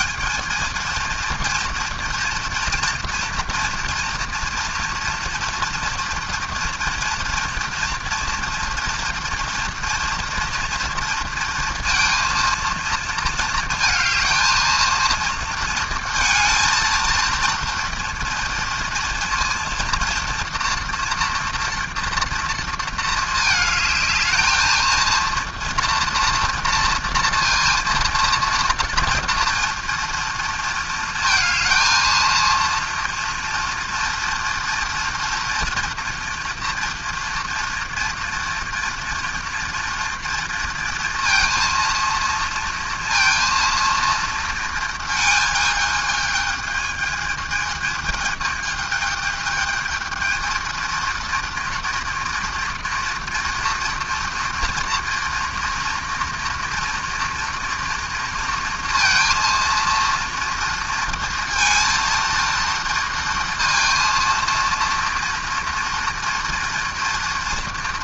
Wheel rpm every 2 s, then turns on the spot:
230, 230, 230, 230, 230, 230, 230, 230, 220, 230, 240, 220, 220, 230, 230, 230, 230, 230, 240, 230, 230, 230, 220, 220, 220, 230, 230, 230, 230, 230, 230, 230, 230, 230.
none